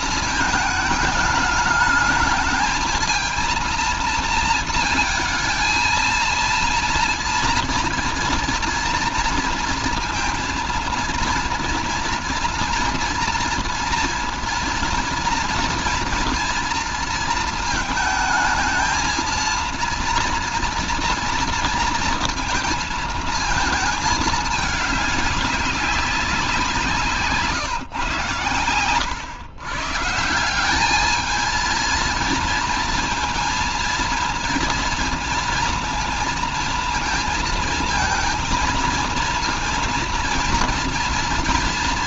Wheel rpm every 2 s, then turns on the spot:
220, 220, 230, 230, 230, 230, 230, 230, 230, 230, 240, 230, 210, 170, 120, 190, 230, 230, 230, 230, 230.
none